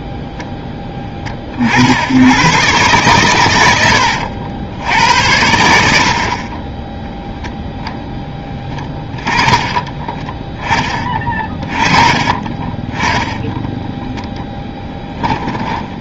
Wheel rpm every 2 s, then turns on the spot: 10, 120, 80, 20, 10, 10, 20, 0.
none